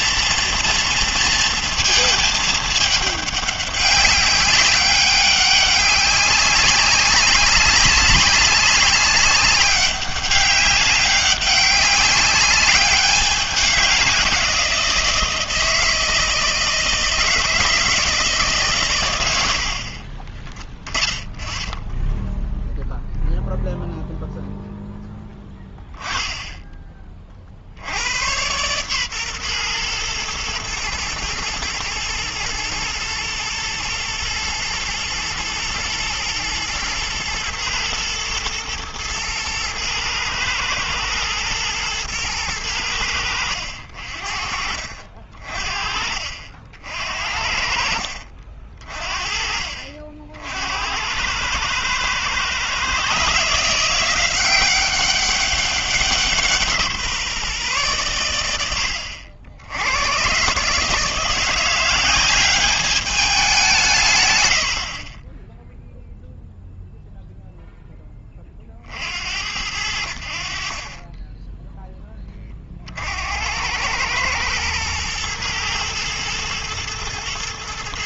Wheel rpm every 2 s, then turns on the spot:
230, 220, 200, 190, 200, 200, 200, 180, 160, 150, 20, 0, 0, 10, 110, 120, 110, 120, 110, 120, 120, 110, 50, 60, 50, 70, 120, 180, 170, 100, 130, 200, 90, 0, 30, 50, 30, 110, 110.
none